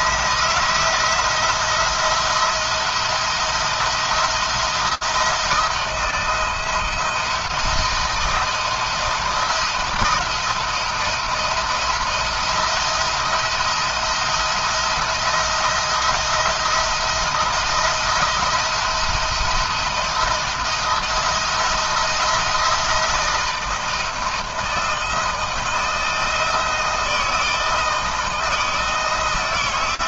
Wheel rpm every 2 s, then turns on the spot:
170, 170, 170, 170, 170, 170, 170, 170, 160, 170, 170, 160, 160, 160, 160.
none